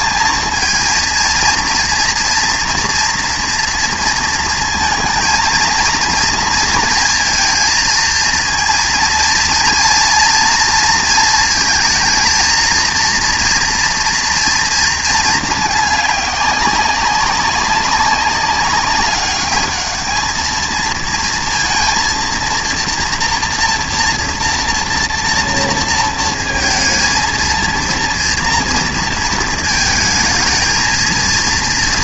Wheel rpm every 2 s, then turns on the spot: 230, 230, 220, 230, 230, 230, 230, 230, 190, 200, 230, 230, 230, 230, 230, 230.
none